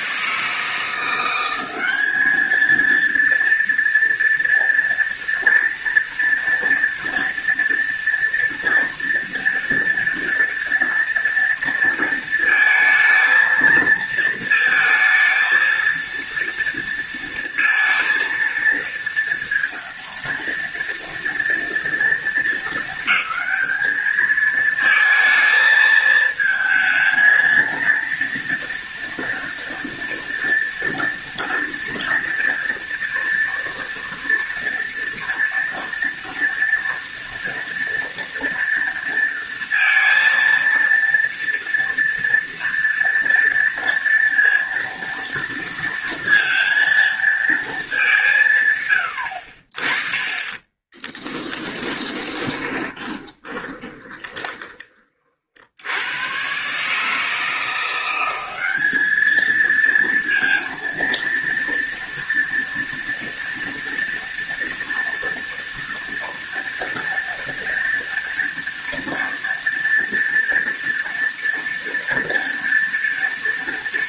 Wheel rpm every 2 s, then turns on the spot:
150, 210, 230, 230, 240, 230, 230, 230, 230, 230, 230, 230, 220, 220, 230, 240, 230, 230, 230, 230, 230, 240, 230, 230, 170, 30, 20, 20, 110, 190, 230, 230, 230, 230, 230, 230, 230.
50-56